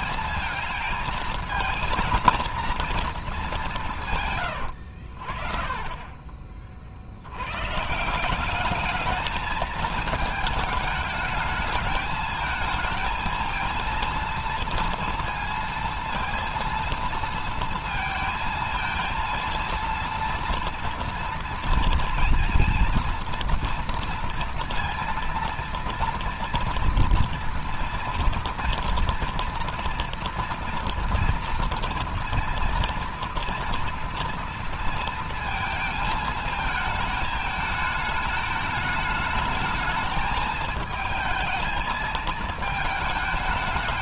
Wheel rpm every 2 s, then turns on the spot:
220, 230, 100, 40, 200, 220, 220, 230, 230, 230, 230, 230, 230, 230, 230, 230, 230, 230, 220, 210, 220, 220.
none